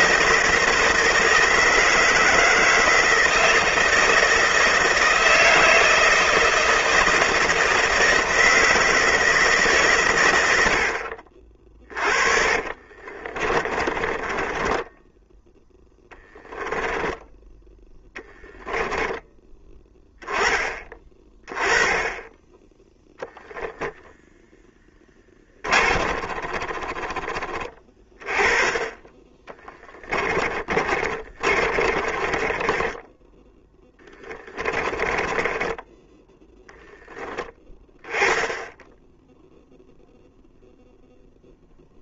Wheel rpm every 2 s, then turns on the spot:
160, 160, 160, 160, 160, 50, 30, 10, 10, 10, 20, 0, 10, 20, 20, 30, 10, 20, 10, 0, 0.
12-16 18-20 24-26 28-36